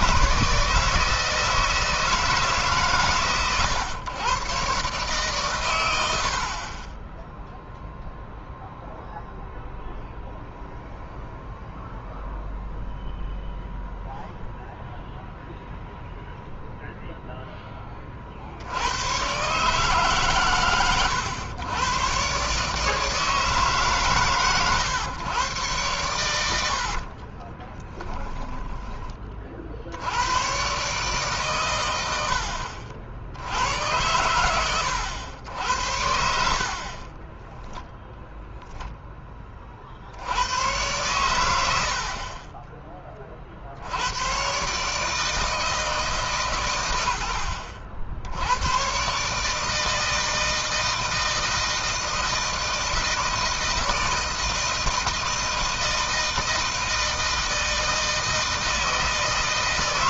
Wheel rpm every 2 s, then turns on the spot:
160, 140, 120, 50, 0, 0, 0, 0, 0, 70, 130, 140, 130, 90, 20, 130, 60, 100, 50, 0, 100, 30, 130, 120, 90, 160, 160, 160, 160, 160.
26-28